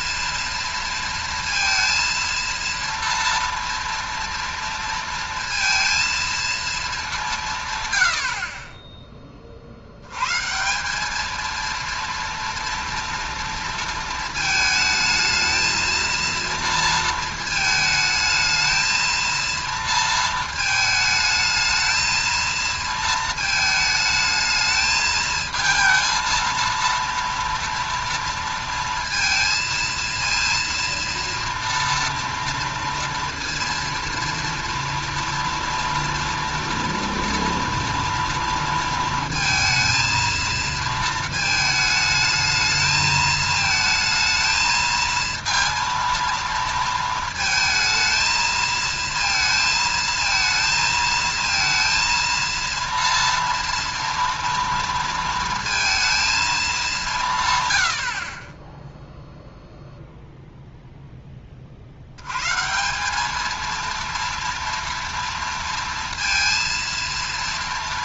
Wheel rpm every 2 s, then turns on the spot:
230, 230, 230, 230, 0, 150, 230, 220, 230, 220, 220, 230, 220, 230, 230, 230, 230, 230, 230, 230, 230, 220, 220, 230, 230, 220, 230, 230, 220, 0, 0, 140, 230, 230.
none